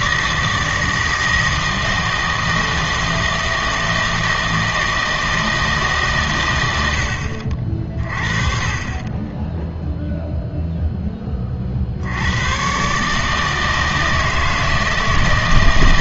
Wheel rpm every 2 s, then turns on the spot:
160, 160, 160, 90, 30, 0, 120, 160.
none